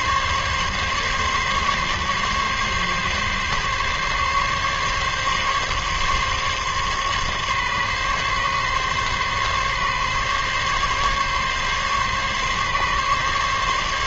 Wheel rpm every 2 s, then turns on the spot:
140, 140, 140, 140, 140, 140, 140.
none